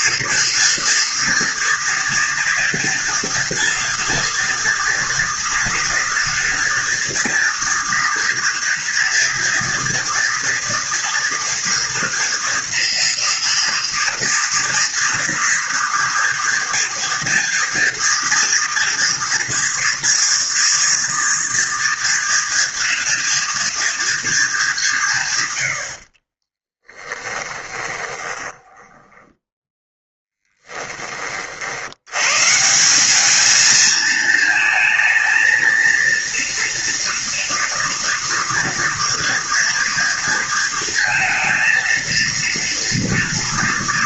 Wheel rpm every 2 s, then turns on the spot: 230, 230, 230, 230, 230, 240, 230, 230, 230, 230, 230, 240, 200, 30, 10, 10, 170, 220, 230, 240, 230, 240.
26-30